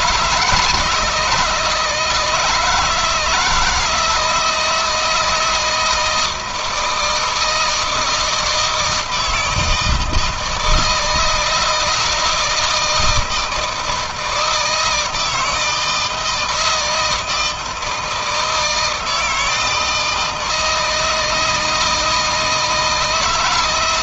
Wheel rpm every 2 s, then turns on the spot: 150, 160, 160, 160, 160, 160, 160, 160, 160, 160, 160, 160.
none